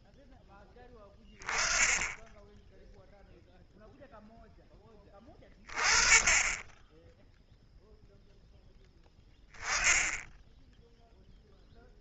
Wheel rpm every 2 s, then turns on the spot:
10, 0, 20, 0, 10, 0.
none